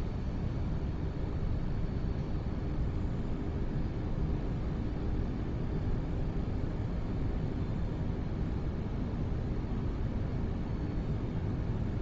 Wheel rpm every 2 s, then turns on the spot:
0, 0, 0, 0, 0, 0.
none